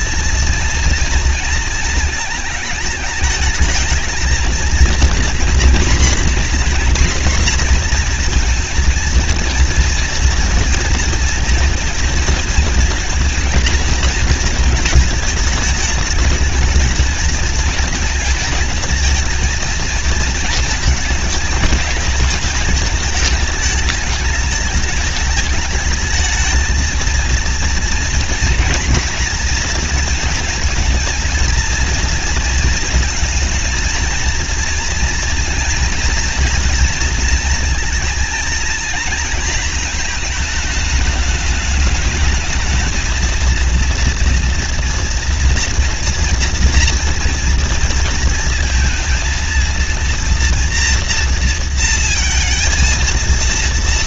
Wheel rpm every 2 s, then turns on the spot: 230, 220, 230, 250, 240, 230, 230, 220, 220, 230, 230, 220, 220, 220, 240, 230, 230, 230, 240, 230, 220, 220, 230, 240, 230, 230, 230.
none